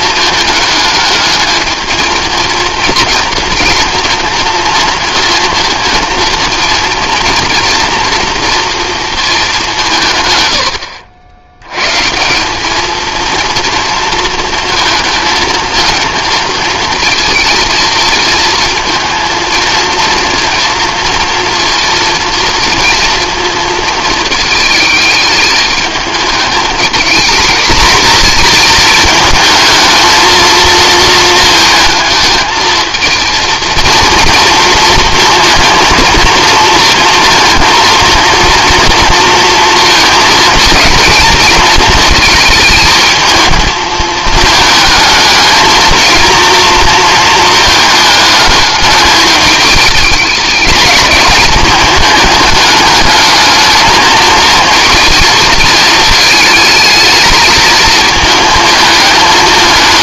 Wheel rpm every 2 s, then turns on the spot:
220, 230, 230, 230, 220, 80, 230, 220, 220, 230, 230, 230, 220, 230, 220, 220, 230, 230, 230, 230, 230, 220, 220, 230, 210, 210, 210, 220, 220, 220.
none